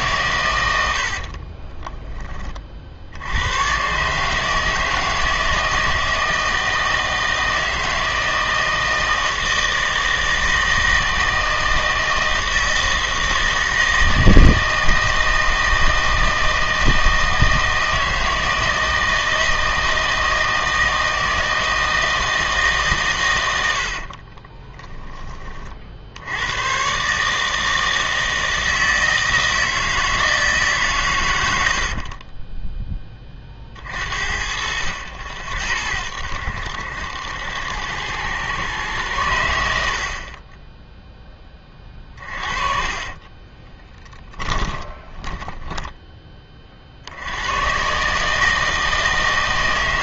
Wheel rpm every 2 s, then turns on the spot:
100, 40, 160, 160, 160, 160, 160, 160, 160, 160, 160, 150, 20, 120, 160, 140, 10, 60, 80, 110, 10, 30, 10, 40, 160.
24-26 42-46